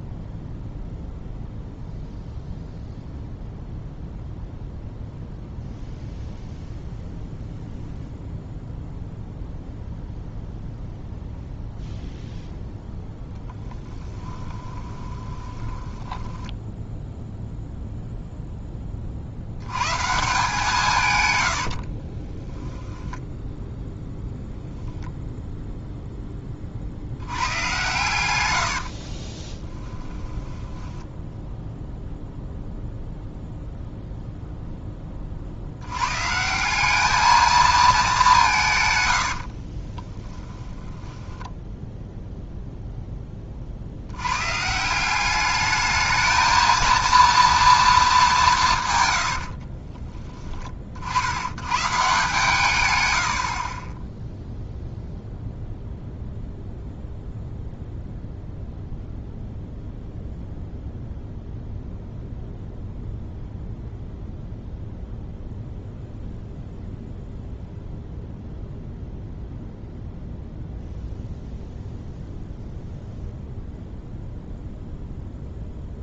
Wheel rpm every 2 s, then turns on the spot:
0, 0, 0, 0, 0, 0, 0, 20, 10, 20, 150, 10, 0, 30, 90, 10, 0, 10, 190, 140, 20, 0, 150, 230, 160, 40, 110, 0, 0, 0, 0, 0, 0, 0, 0, 0, 0, 0.
14-18 22-24 28-32 40-42